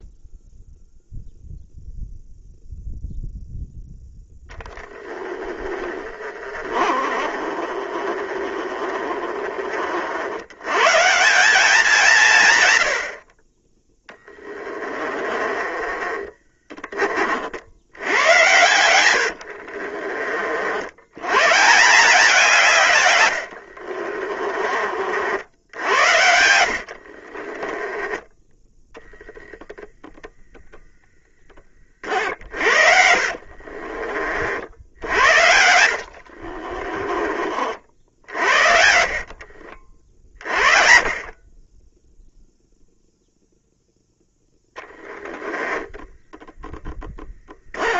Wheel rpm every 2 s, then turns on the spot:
0, 0, 10, 30, 30, 140, 100, 20, 30, 100, 80, 130, 50, 50, 0, 0, 60, 80, 30, 60, 40, 0, 10, 10.
4-10 14-16 18-20 26-28 32-34 36-38 44-48